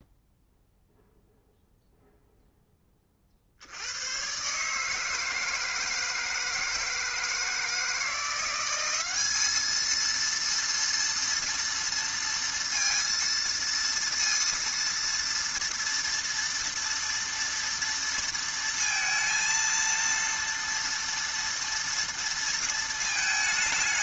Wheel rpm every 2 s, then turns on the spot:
0, 30, 160, 160, 200, 230, 230, 230, 230, 230, 230, 220.
none